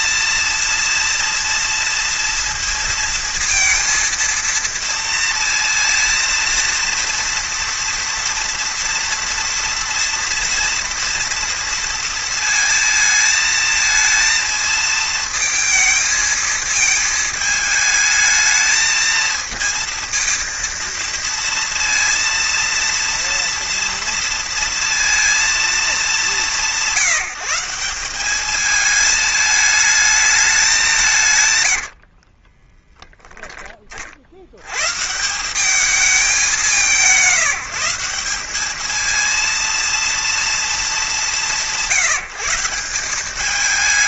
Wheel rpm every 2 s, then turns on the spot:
230, 230, 230, 230, 230, 230, 220, 220, 220, 220, 230, 230, 230, 170, 210, 190, 10, 120, 180, 210, 210, 180.
32-34